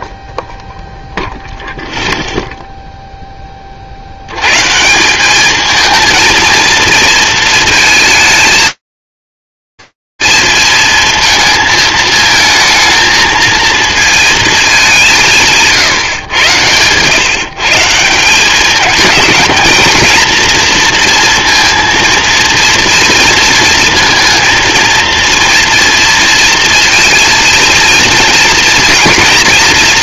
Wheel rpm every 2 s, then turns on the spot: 0, 0, 70, 220, 220, 220, 220, 150, 140, 220, 230, 230, 230, 230, 240.
none